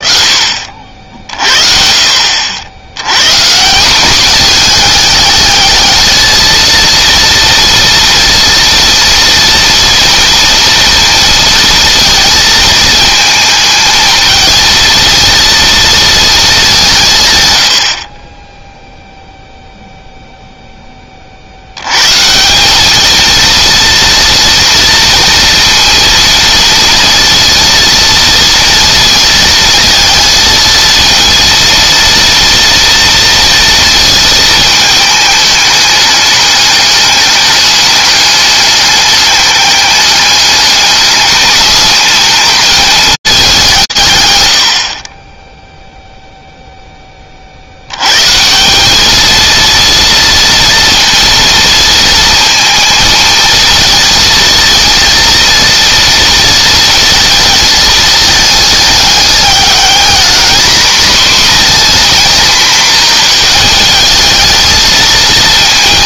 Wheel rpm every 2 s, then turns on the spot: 50, 80, 220, 230, 230, 230, 220, 230, 190, 0, 10, 190, 230, 230, 230, 220, 230, 220, 210, 210, 200, 220, 110, 0, 170, 230, 230, 230, 230, 220, 240, 230, 220.
none